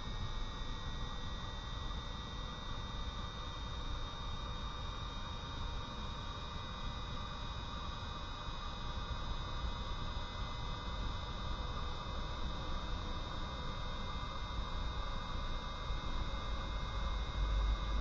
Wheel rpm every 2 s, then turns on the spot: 0, 0, 0, 0, 0, 0, 0, 0, 0.
none